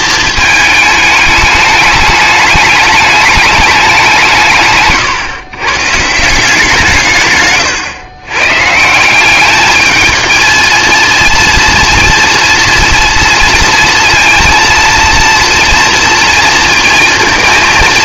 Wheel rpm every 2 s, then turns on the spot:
220, 210, 140, 170, 150, 220, 230, 230, 230.
4-6